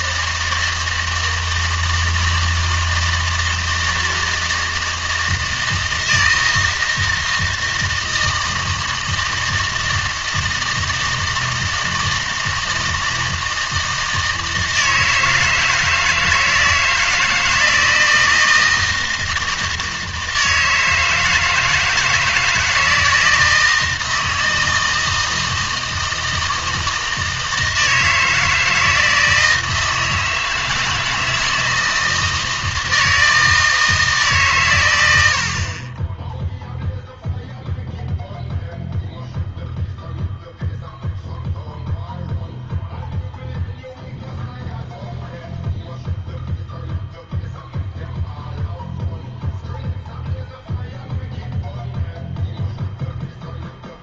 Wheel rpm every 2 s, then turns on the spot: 160, 160, 160, 160, 160, 160, 160, 160, 160, 160, 160, 160, 160, 160, 160, 160, 160, 130, 0, 0, 0, 0, 0, 0, 0, 0, 0.
none